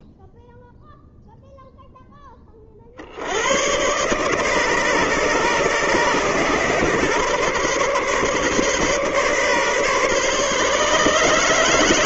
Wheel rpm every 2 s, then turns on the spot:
0, 30, 140, 130, 130, 140.
none